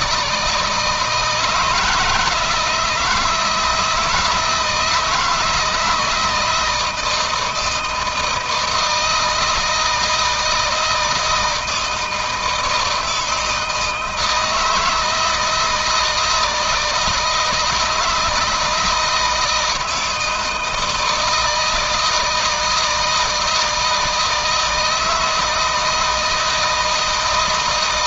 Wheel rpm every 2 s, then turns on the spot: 160, 160, 160, 160, 160, 160, 160, 160, 160, 160, 160, 160, 160, 160.
none